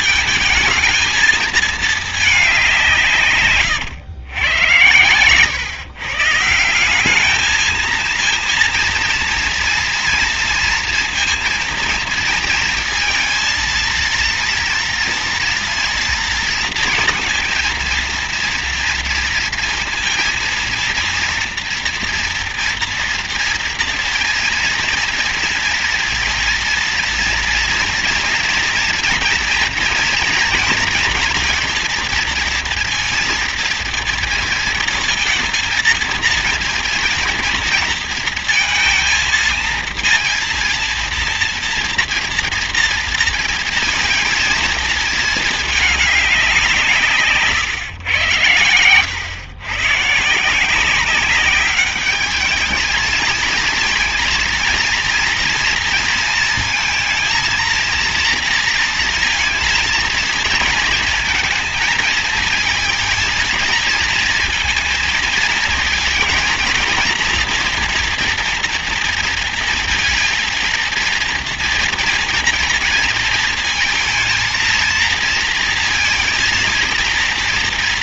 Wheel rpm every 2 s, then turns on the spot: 230, 180, 110, 170, 230, 230, 230, 230, 230, 230, 230, 230, 230, 230, 240, 230, 230, 230, 230, 220, 230, 230, 230, 170, 100, 180, 210, 230, 230, 230, 230, 230, 230, 230, 230, 230, 230, 230, 230.
none